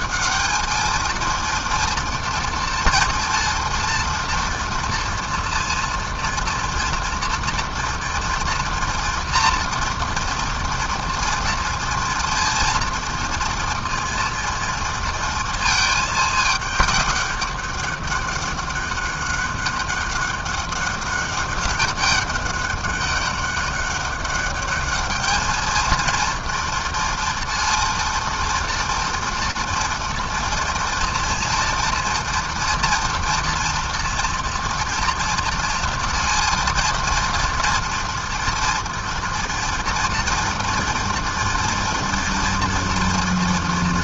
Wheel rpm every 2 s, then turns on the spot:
220, 240, 230, 240, 230, 230, 230, 230, 210, 200, 200, 200, 200, 230, 230, 230, 230, 230, 230, 230, 230, 230.
none